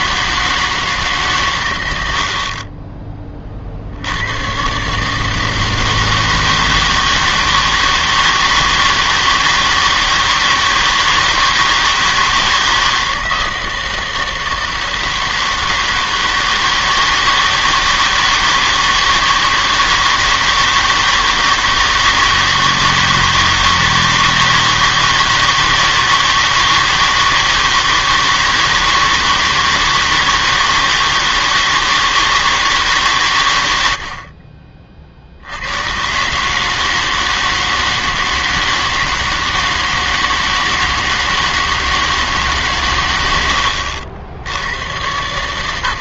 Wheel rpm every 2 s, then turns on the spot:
160, 30, 120, 160, 160, 160, 160, 160, 160, 160, 160, 160, 160, 160, 160, 160, 160, 40, 150, 160, 160, 140, 90.
none